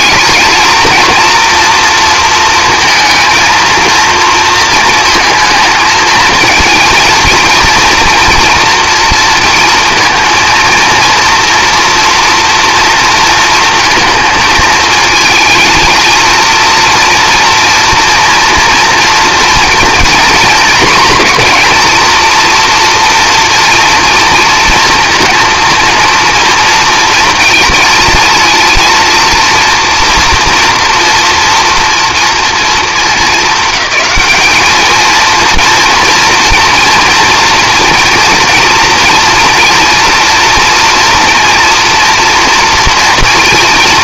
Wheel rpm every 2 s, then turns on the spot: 230, 230, 230, 230, 230, 230, 230, 220, 230, 230, 240, 230, 230, 230, 230, 240, 220, 210, 240, 240, 240, 230.
none